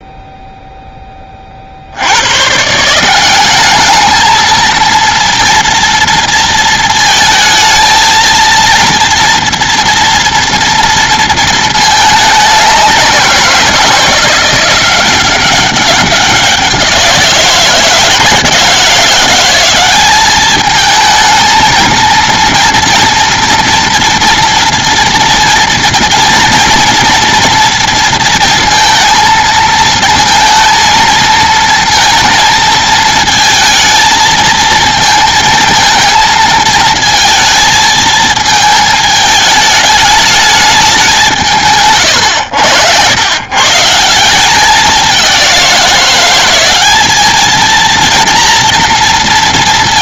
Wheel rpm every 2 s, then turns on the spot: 0, 170, 230, 220, 230, 230, 190, 180, 180, 170, 220, 230, 230, 230, 230, 230, 220, 230, 230, 220, 200, 90, 200, 200, 230.
none